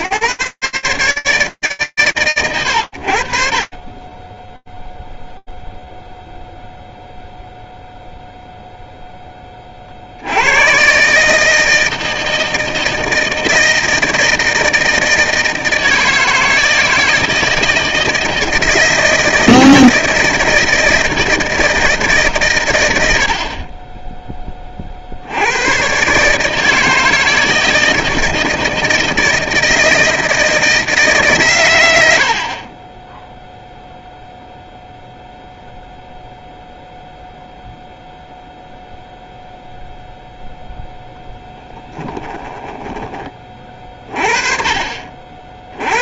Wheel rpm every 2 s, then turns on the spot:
90, 0, 0, 0, 90, 160, 160, 160, 160, 160, 130, 10, 140, 160, 160, 70, 0, 0, 0, 0, 10, 30, 70.
40-42